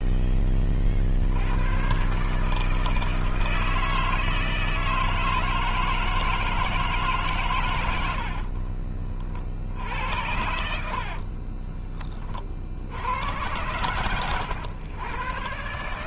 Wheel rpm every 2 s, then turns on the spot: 30, 140, 160, 160, 50, 70, 60, 100.
8-12